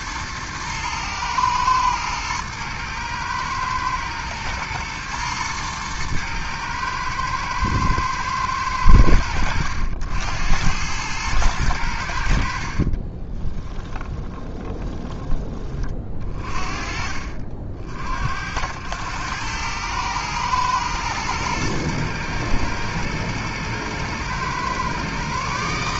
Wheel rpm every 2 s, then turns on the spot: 110, 110, 110, 110, 100, 90, 60, 20, 40, 80, 110, 110, 120.
12-16